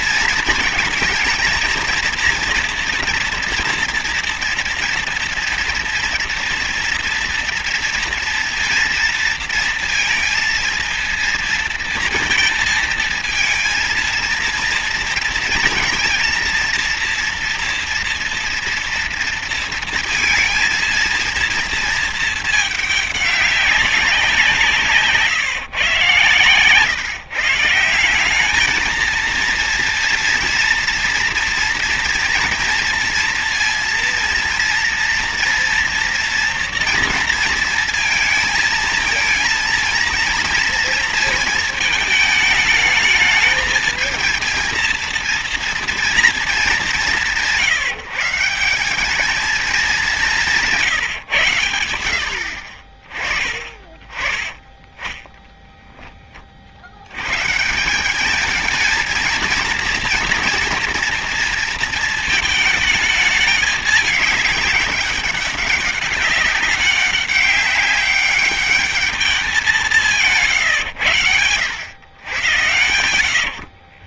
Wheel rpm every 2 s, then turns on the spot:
220, 230, 230, 230, 230, 230, 230, 230, 230, 230, 230, 220, 170, 130, 200, 230, 230, 230, 230, 230, 230, 220, 220, 220, 170, 180, 60, 30, 40, 200, 240, 220, 210, 200, 200, 150, 100.
26-28